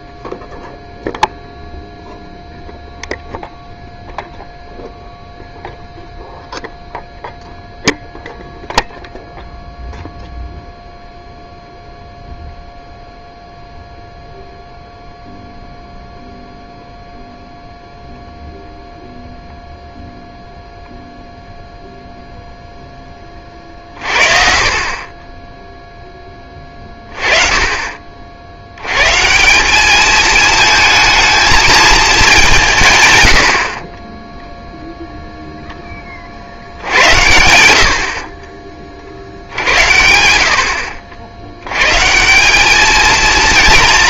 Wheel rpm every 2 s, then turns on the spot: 0, 0, 0, 0, 0, 0, 0, 0, 0, 0, 0, 0, 40, 30, 90, 220, 150, 0, 70, 30, 50, 200.
none